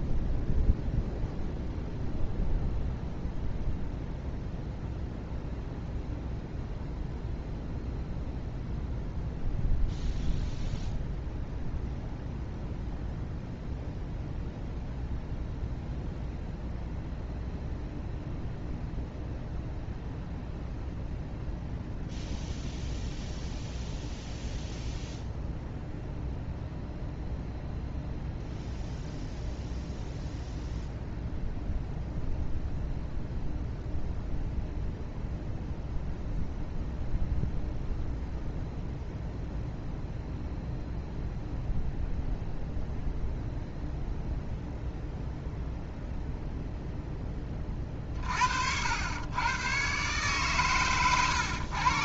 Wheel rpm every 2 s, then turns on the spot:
0, 0, 0, 0, 0, 0, 0, 0, 0, 0, 0, 0, 0, 0, 0, 0, 0, 0, 0, 0, 0, 0, 0, 0, 80, 130.
none